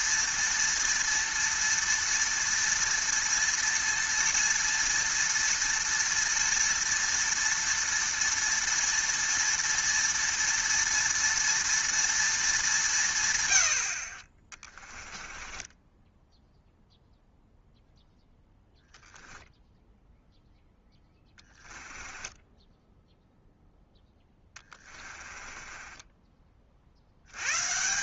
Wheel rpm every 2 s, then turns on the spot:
230, 230, 230, 230, 230, 230, 200, 20, 0, 10, 0, 10, 20, 30.
14-16 22-26